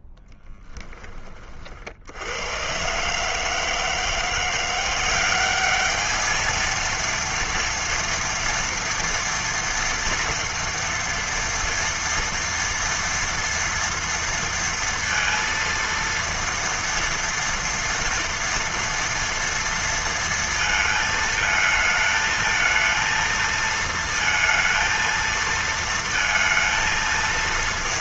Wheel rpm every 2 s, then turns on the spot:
10, 90, 170, 220, 230, 230, 230, 230, 230, 230, 230, 220, 230, 230.
0-2